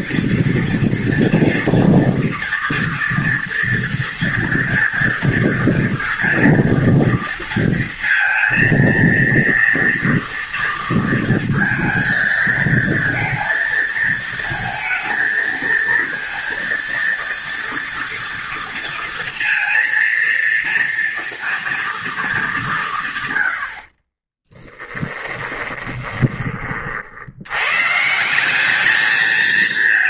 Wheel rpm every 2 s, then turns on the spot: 230, 230, 240, 230, 230, 230, 230, 230, 230, 230, 230, 190, 20, 40, 200.
24-26